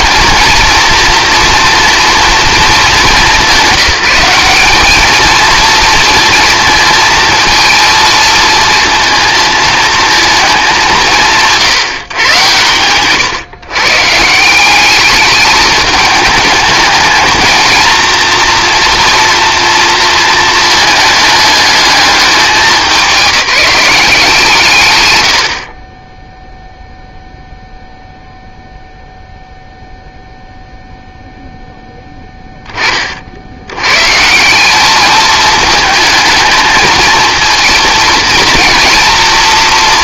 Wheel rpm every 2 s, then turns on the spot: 230, 210, 210, 230, 230, 190, 110, 200, 220, 230, 220, 180, 140, 0, 0, 0, 20, 190, 220, 230.
none